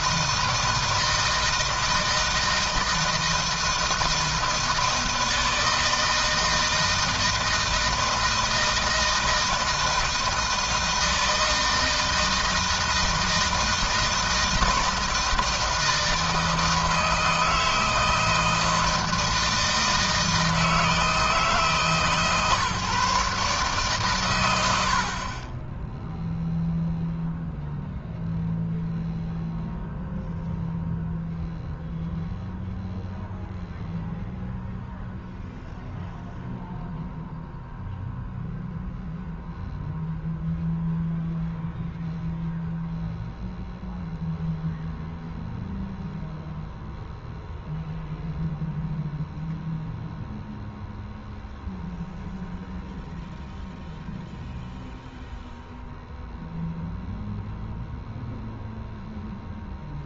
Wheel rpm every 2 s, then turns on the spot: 160, 160, 160, 160, 160, 160, 160, 160, 160, 160, 160, 150, 70, 0, 0, 0, 0, 0, 0, 0, 0, 0, 0, 0, 0, 0, 0, 0, 0, 0.
none